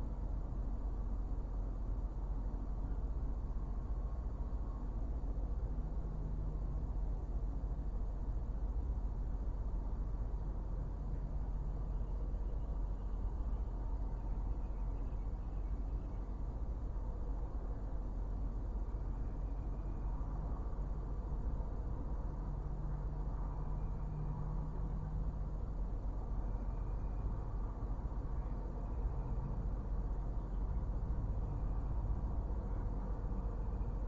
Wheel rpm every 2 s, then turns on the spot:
0, 0, 0, 0, 0, 0, 0, 0, 0, 0, 0, 0, 0, 0, 0, 0, 0.
none